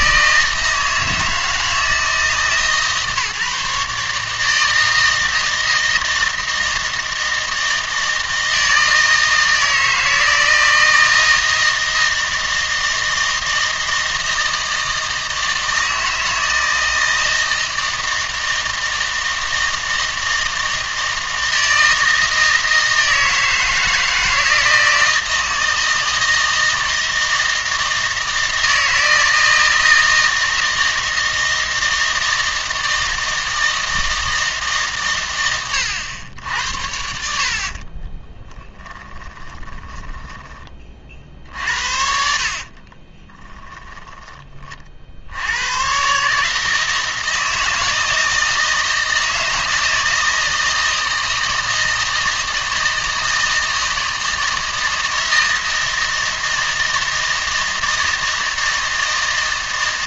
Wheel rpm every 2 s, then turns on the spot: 160, 150, 160, 160, 160, 160, 160, 160, 160, 160, 160, 160, 160, 160, 160, 160, 160, 150, 80, 10, 20, 50, 30, 160, 160, 160, 160, 160, 160, 160.
38-40 42-44